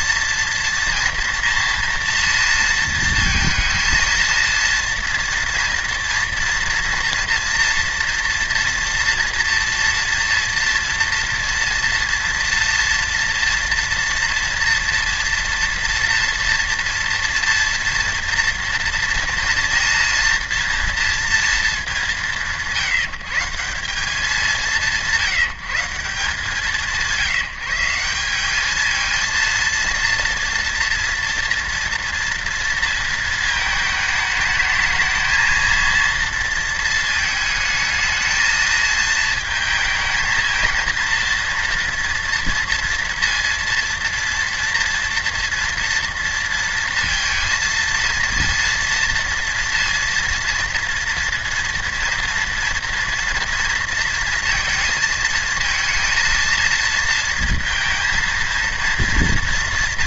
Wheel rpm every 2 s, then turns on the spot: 230, 230, 230, 230, 240, 230, 230, 240, 230, 230, 230, 150, 180, 160, 210, 230, 230, 210, 230, 220, 230, 230, 230, 230, 230, 230, 230, 230, 220, 230.
none